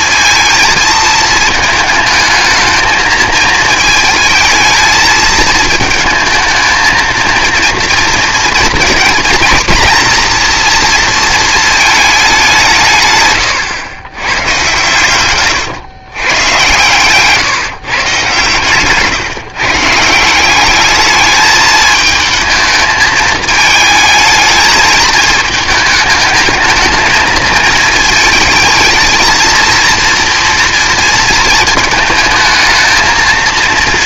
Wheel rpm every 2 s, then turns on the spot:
220, 220, 220, 220, 230, 230, 180, 110, 130, 140, 200, 220, 220, 220, 220, 230, 220.
none